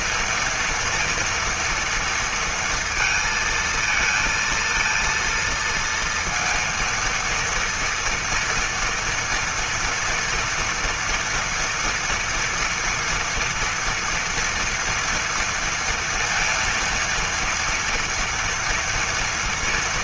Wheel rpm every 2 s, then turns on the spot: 230, 230, 230, 230, 230, 240, 230, 230, 230, 230.
none